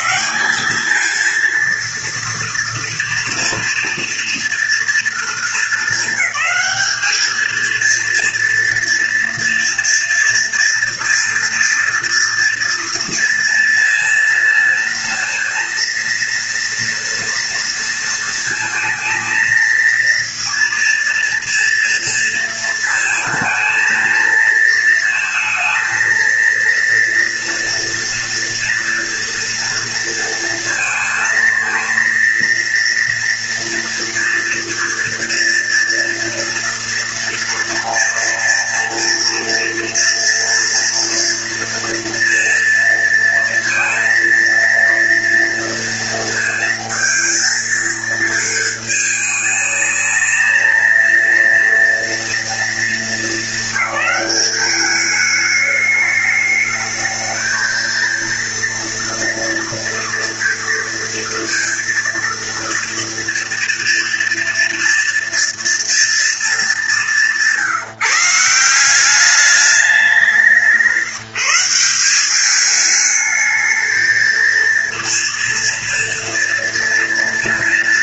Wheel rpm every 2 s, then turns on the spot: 210, 230, 230, 200, 230, 230, 230, 230, 230, 230, 230, 230, 220, 230, 230, 230, 230, 230, 230, 230, 230, 230, 230, 230, 220, 220, 230, 210, 220, 230, 230, 230, 230, 210, 170, 180, 210, 230, 230.
none